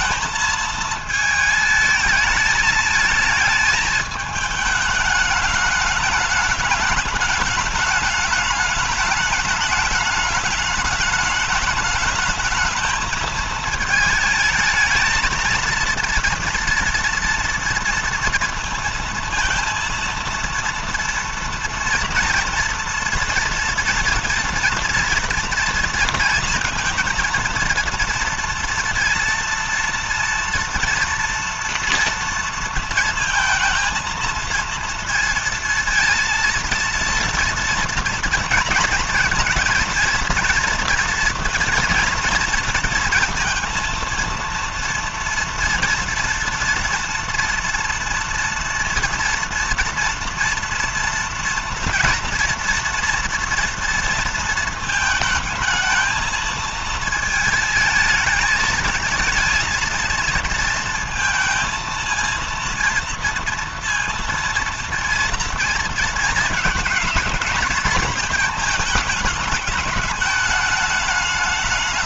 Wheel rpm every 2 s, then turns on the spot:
220, 220, 210, 210, 210, 220, 220, 220, 230, 230, 230, 230, 240, 230, 230, 230, 230, 230, 230, 230, 230, 230, 230, 230, 230, 230, 230, 220, 220, 220, 230, 230, 230, 230, 220, 210.
none